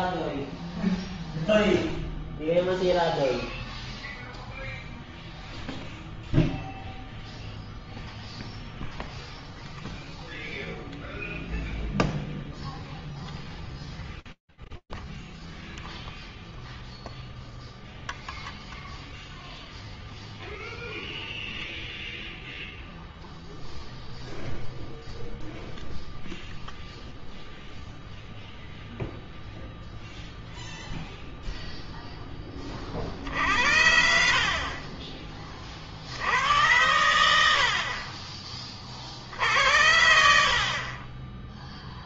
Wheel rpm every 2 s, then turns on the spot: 0, 0, 0, 0, 0, 0, 0, 0, 0, 0, 0, 0, 0, 0, 0, 0, 40, 30, 90, 40, 30.
none